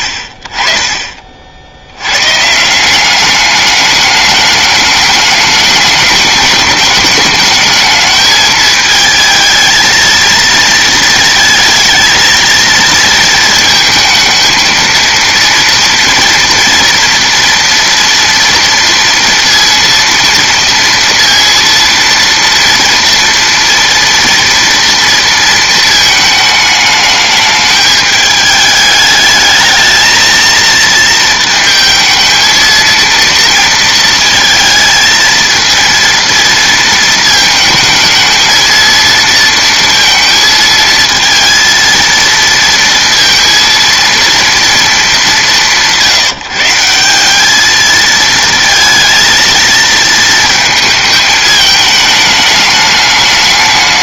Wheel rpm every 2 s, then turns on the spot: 60, 160, 210, 210, 220, 230, 230, 230, 240, 230, 230, 230, 230, 220, 210, 230, 230, 230, 230, 220, 230, 230, 230, 160, 230, 220, 210.
none